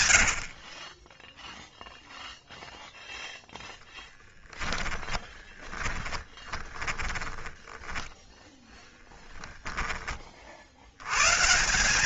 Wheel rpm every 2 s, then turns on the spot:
50, 0, 10, 30, 20, 80.
0-2 4-10